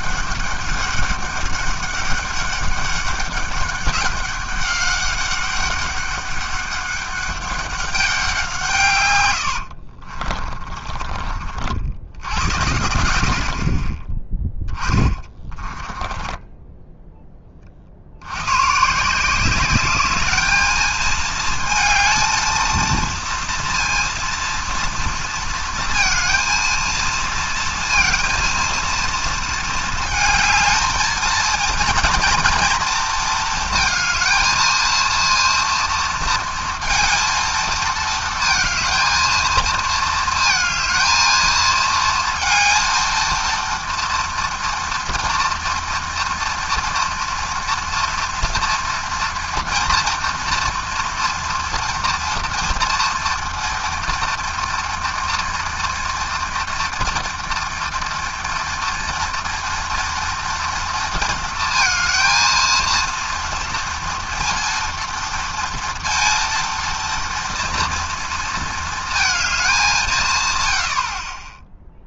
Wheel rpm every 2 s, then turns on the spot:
200, 200, 200, 200, 160, 30, 90, 10, 10, 120, 210, 220, 230, 230, 230, 220, 230, 220, 230, 220, 220, 230, 230, 240, 240, 230, 230, 230, 230, 230, 230, 230, 230, 230, 220, 120.
10-12 14-18